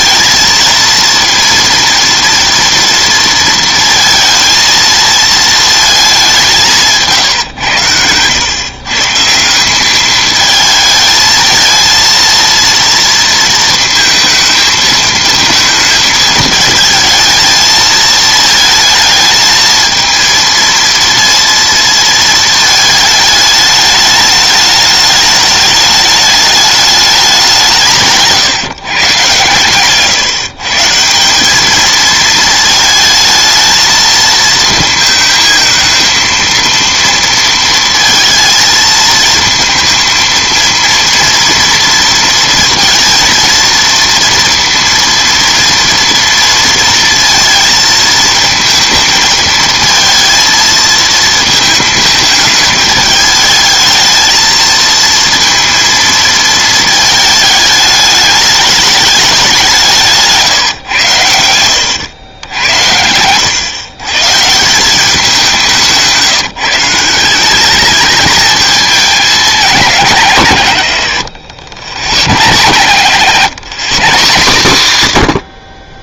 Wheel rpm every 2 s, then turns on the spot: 230, 230, 220, 170, 140, 220, 230, 230, 220, 220, 230, 220, 210, 210, 140, 140, 220, 220, 230, 220, 230, 230, 230, 230, 220, 220, 210, 220, 220, 210, 150, 90, 170, 170, 210, 110, 120, 140.
none